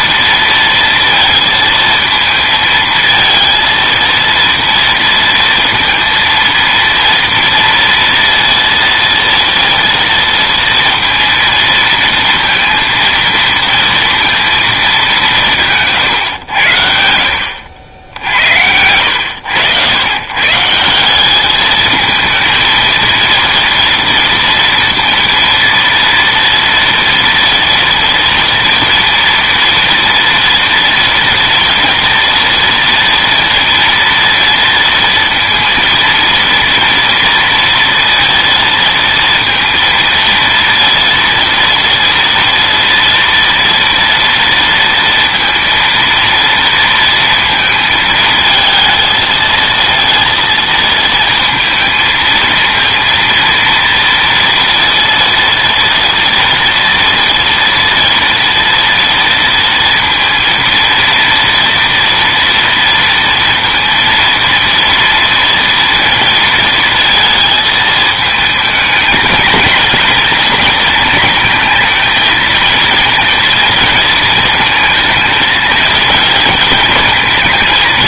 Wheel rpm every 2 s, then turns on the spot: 230, 220, 230, 230, 230, 230, 230, 220, 90, 80, 150, 230, 230, 230, 230, 230, 230, 230, 230, 230, 230, 230, 230, 230, 220, 230, 230, 230, 230, 230, 230, 230, 230, 230, 220, 220, 220, 220, 220.
none